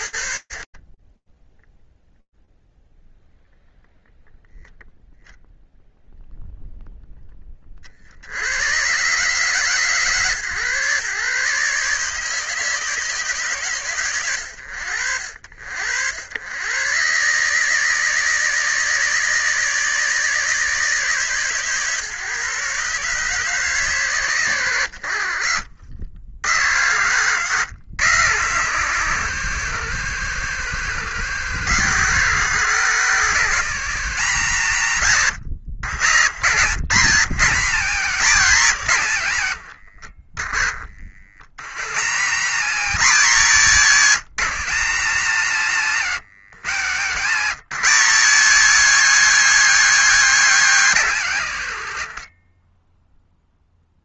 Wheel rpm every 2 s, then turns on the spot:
20, 0, 0, 0, 120, 130, 150, 80, 120, 160, 150, 140, 100, 100, 100, 90, 140, 100, 140, 110, 40, 170, 110, 110, 260, 140, 0.
none